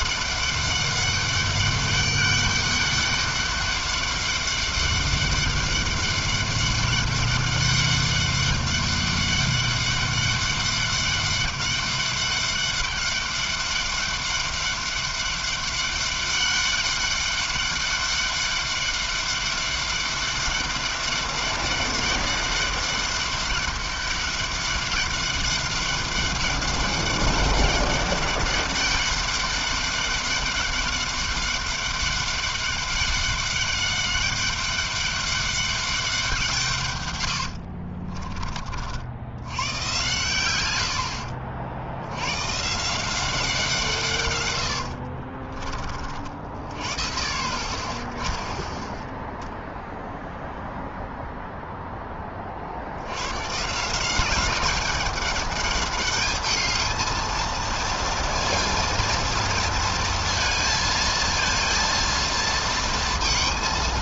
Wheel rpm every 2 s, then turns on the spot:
200, 200, 200, 200, 200, 200, 200, 200, 190, 200, 200, 200, 200, 200, 200, 200, 200, 200, 170, 50, 110, 110, 110, 50, 10, 0, 40, 200, 210, 230, 230, 230.
38-40